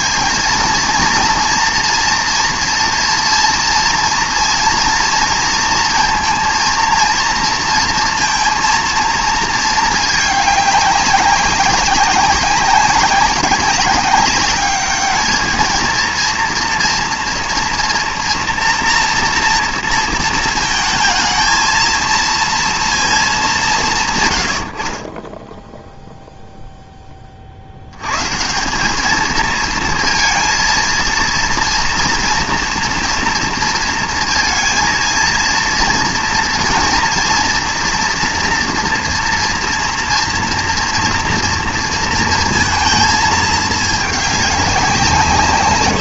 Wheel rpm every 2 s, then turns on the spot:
230, 230, 230, 230, 230, 200, 190, 210, 230, 230, 220, 230, 40, 10, 200, 230, 230, 230, 240, 240, 230, 220, 190.
none